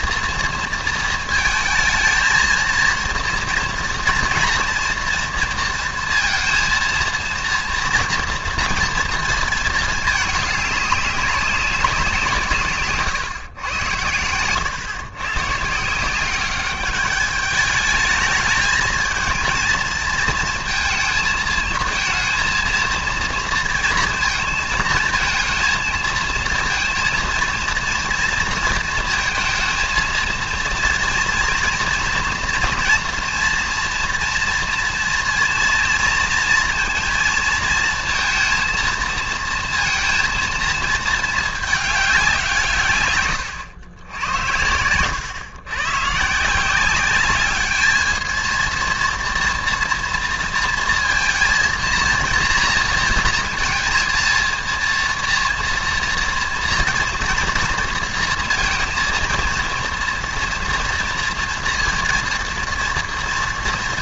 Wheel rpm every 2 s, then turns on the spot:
230, 230, 230, 230, 230, 210, 160, 120, 200, 220, 230, 230, 220, 230, 230, 230, 230, 230, 230, 230, 230, 160, 100, 180, 230, 230, 230, 230, 240, 230, 230, 230.
none